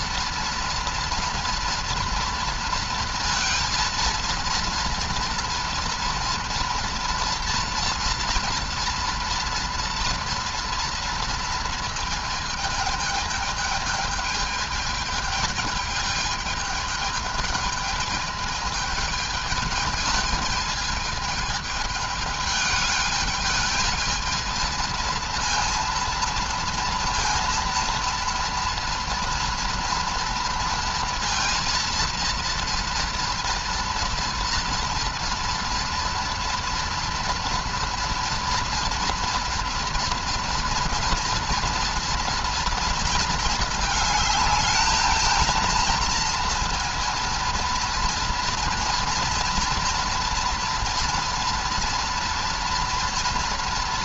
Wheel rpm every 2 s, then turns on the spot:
230, 230, 230, 230, 230, 230, 220, 220, 220, 220, 220, 220, 230, 230, 230, 230, 230, 230, 240, 230, 230, 230, 210, 230, 230, 240, 230.
none